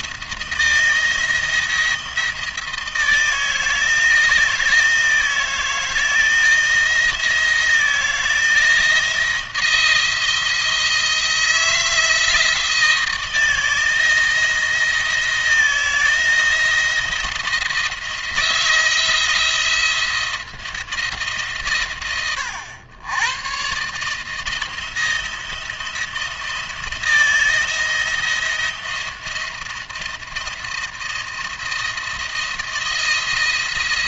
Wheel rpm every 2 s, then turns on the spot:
170, 160, 160, 160, 160, 160, 160, 160, 160, 170, 170, 110, 160, 170, 170, 170, 170.
none